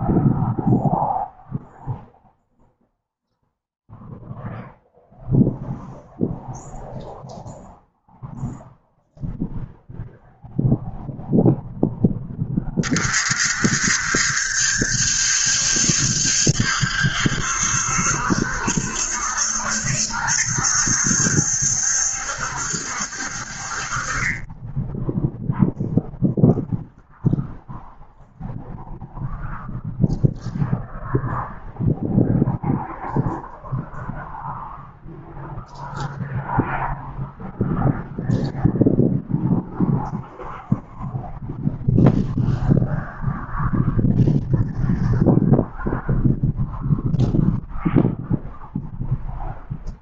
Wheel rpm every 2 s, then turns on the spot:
0, 0, 0, 0, 0, 0, 30, 70, 70, 70, 70, 60, 10, 0, 0, 0, 0, 0, 0, 0, 0, 0, 0, 0, 0.
none